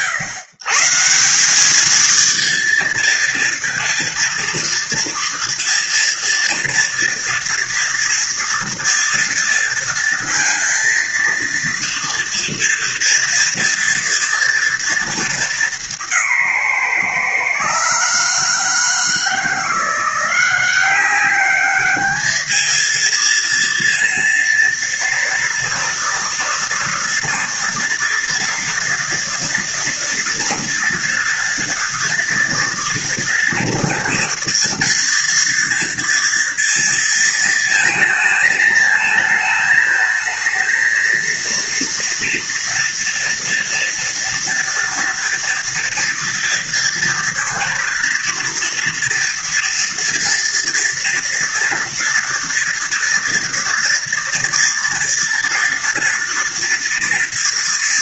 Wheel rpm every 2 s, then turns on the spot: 140, 230, 230, 230, 230, 230, 230, 230, 150, 160, 190, 220, 230, 230, 230, 230, 240, 230, 230, 220, 230, 230, 230, 230, 230, 230, 230, 230, 230.
none